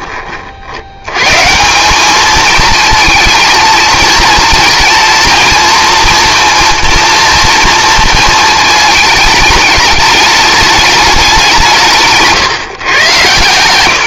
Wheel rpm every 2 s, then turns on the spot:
70, 220, 230, 230, 220, 210, 140.
none